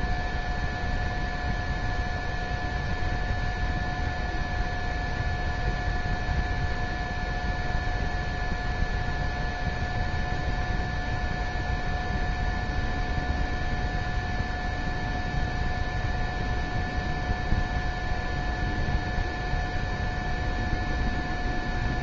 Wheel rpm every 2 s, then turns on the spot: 0, 0, 0, 0, 0, 0, 0, 0, 0, 0, 0.
none